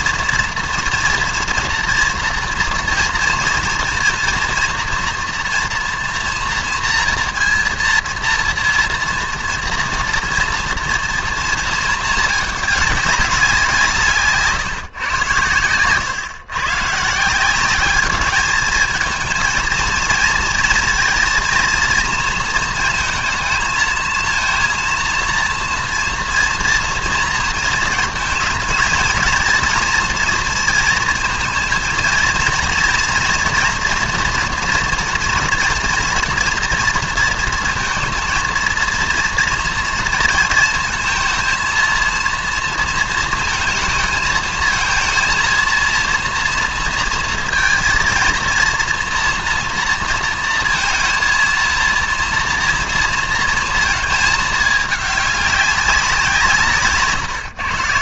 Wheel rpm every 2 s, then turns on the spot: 230, 230, 240, 230, 230, 230, 200, 140, 140, 220, 230, 230, 230, 230, 220, 230, 230, 230, 230, 230, 230, 230, 220, 230, 230, 230, 230, 210, 160.
none